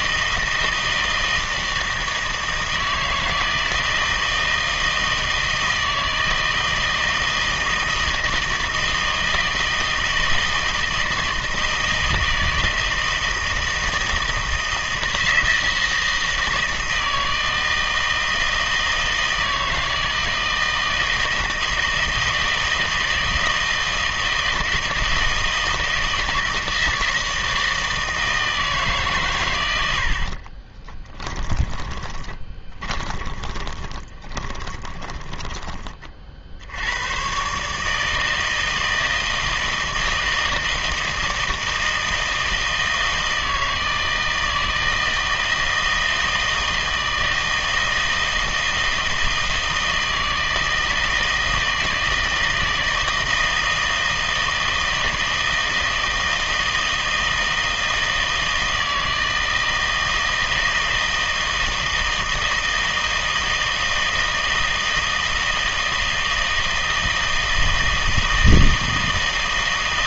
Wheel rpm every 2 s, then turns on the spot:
160, 160, 160, 160, 160, 160, 160, 160, 160, 160, 160, 160, 160, 160, 150, 20, 20, 20, 70, 160, 160, 160, 160, 160, 160, 160, 160, 160, 160, 160, 160, 160, 160, 160, 160.
30-36